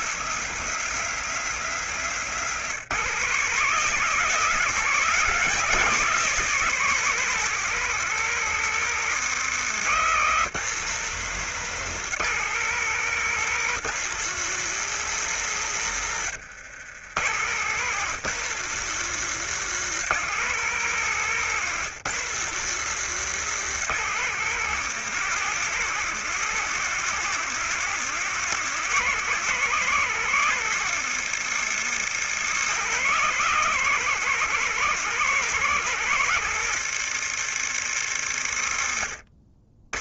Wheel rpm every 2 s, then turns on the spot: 180, 180, 210, 190, 170, 170, 180, 170, 120, 170, 150, 160, 160, 170, 160, 170, 170, 160, 150, 90.
none